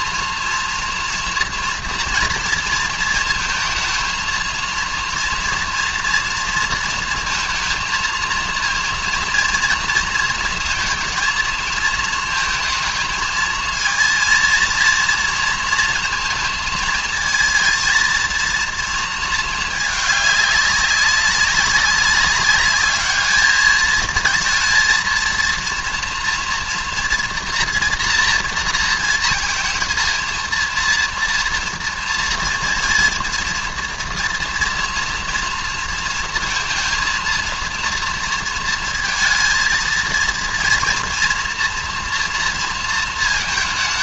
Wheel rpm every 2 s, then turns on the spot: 230, 230, 230, 230, 230, 230, 220, 230, 220, 230, 200, 200, 230, 230, 230, 230, 230, 230, 230, 230, 240, 230.
none